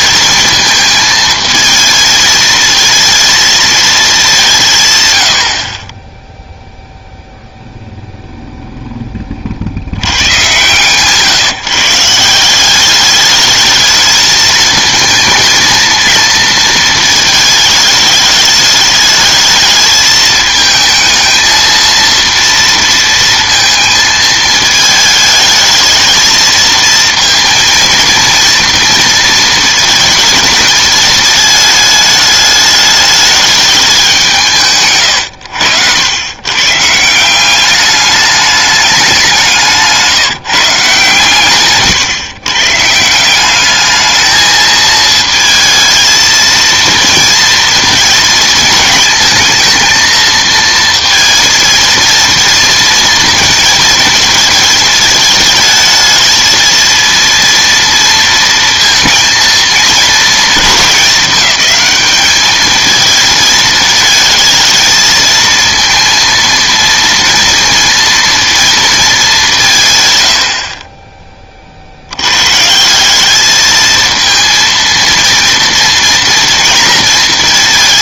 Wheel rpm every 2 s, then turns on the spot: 220, 220, 170, 0, 0, 130, 190, 220, 230, 210, 220, 230, 220, 230, 230, 220, 210, 150, 130, 210, 150, 130, 220, 230, 220, 230, 230, 220, 220, 230, 220, 210, 220, 230, 230, 60, 140, 230, 230.
none